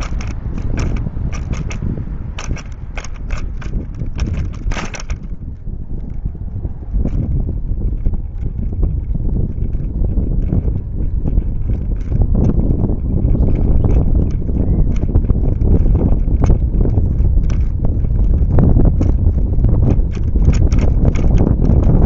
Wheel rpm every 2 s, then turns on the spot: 0, 0, 0, 0, 0, 0, 0, 0, 0, 0, 0.
none